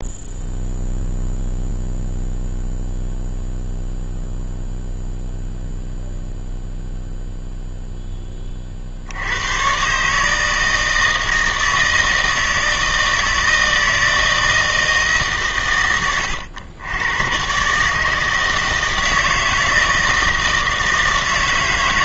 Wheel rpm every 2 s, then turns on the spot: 0, 0, 0, 0, 50, 160, 160, 160, 90, 160, 160.
none